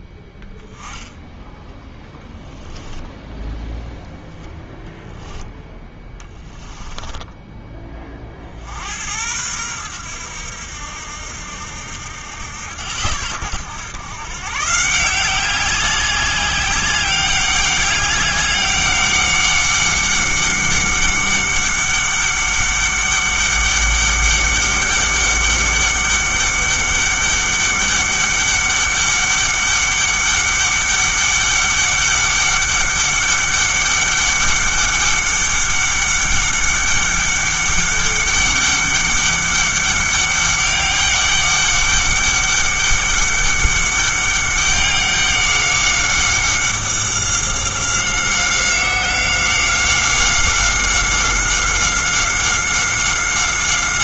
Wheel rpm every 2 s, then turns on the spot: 10, 10, 0, 10, 60, 90, 90, 150, 200, 200, 200, 200, 200, 200, 200, 200, 200, 200, 200, 200, 200, 200, 200, 190, 190, 190, 190.
6-8